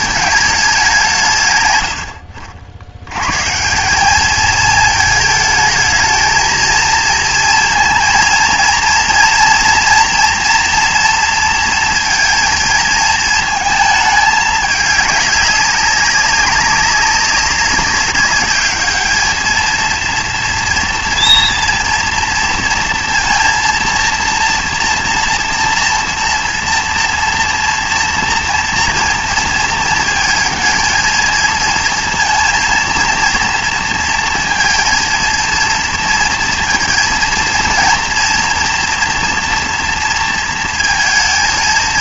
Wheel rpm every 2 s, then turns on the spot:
200, 70, 220, 220, 230, 240, 230, 210, 200, 210, 230, 230, 230, 230, 230, 220, 230, 230, 230, 230, 230.
none